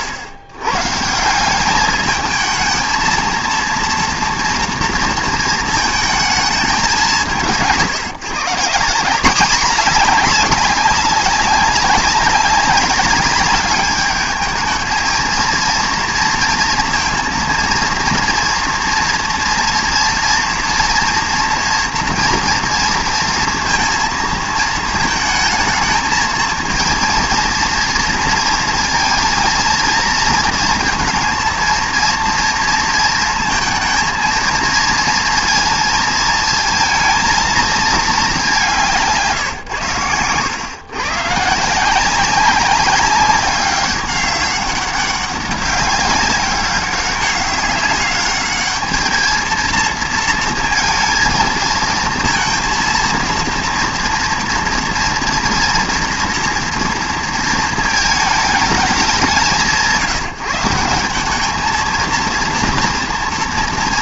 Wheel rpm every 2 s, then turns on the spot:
100, 220, 230, 200, 170, 200, 190, 220, 230, 230, 230, 230, 220, 230, 230, 230, 230, 230, 230, 180, 120, 190, 190, 200, 210, 230, 230, 240, 230, 210, 160, 230.
none